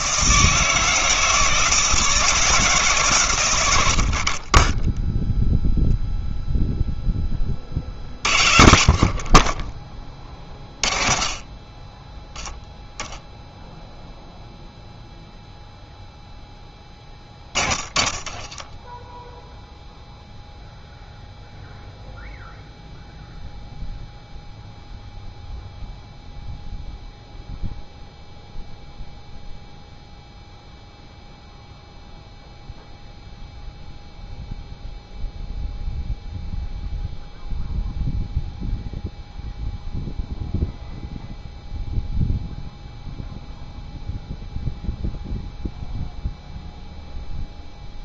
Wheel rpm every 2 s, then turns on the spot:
160, 150, 10, 0, 60, 40, 10, 0, 10, 10, 0, 0, 0, 0, 0, 0, 0, 0, 0, 0, 0, 0, 0, 0.
18-20